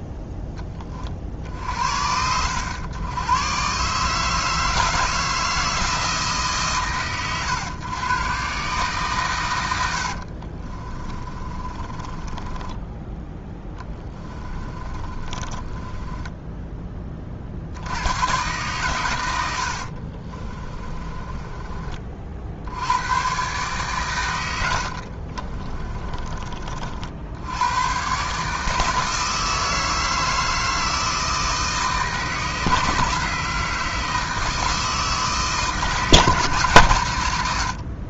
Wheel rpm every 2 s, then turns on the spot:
10, 90, 160, 110, 130, 30, 10, 20, 20, 120, 30, 80, 80, 50, 150, 160, 170, 160, 160.
10-16 20-22 24-26